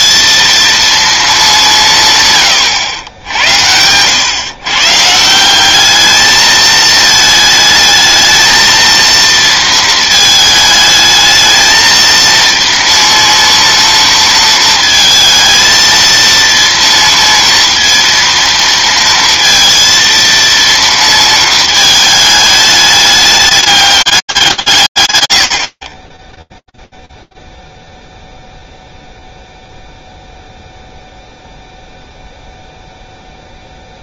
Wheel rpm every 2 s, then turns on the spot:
230, 120, 140, 220, 220, 220, 230, 220, 230, 230, 230, 210, 170, 10, 0, 0, 0.
none